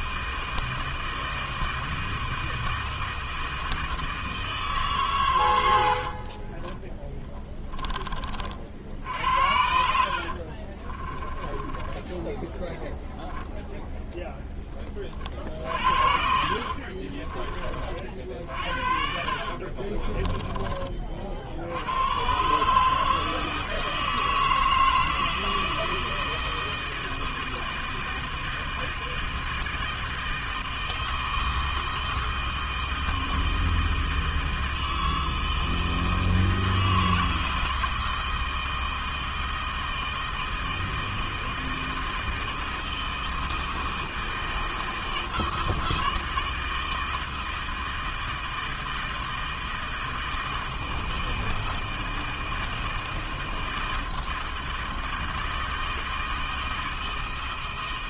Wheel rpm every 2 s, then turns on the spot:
160, 160, 140, 10, 60, 30, 10, 20, 40, 50, 30, 150, 160, 160, 160, 160, 160, 160, 160, 160, 160, 160, 160, 160, 160, 160, 160, 160, 160.
6-8 10-14 16-20